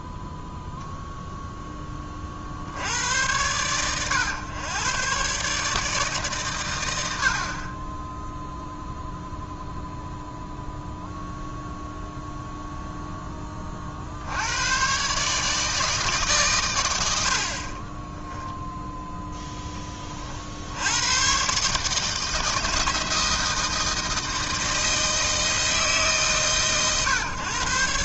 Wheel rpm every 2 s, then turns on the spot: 0, 80, 120, 120, 0, 0, 0, 110, 120, 0, 80, 160, 160, 130.
none